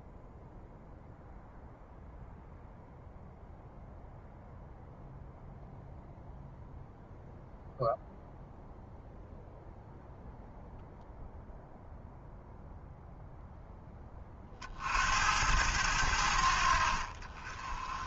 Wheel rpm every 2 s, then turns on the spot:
0, 0, 0, 0, 0, 0, 0, 60, 70.
none